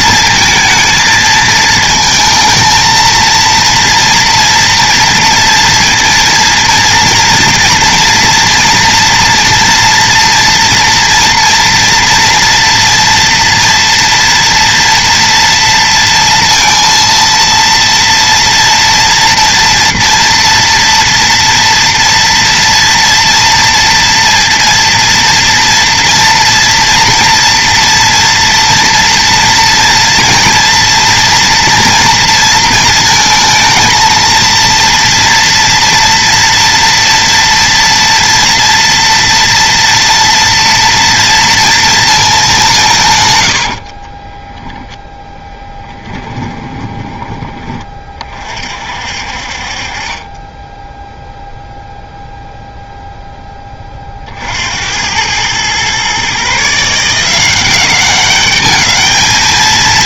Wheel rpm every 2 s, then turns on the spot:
220, 220, 230, 230, 230, 240, 230, 230, 230, 240, 240, 230, 230, 230, 230, 240, 230, 230, 230, 230, 230, 190, 0, 20, 50, 10, 0, 70, 150, 210.
46-48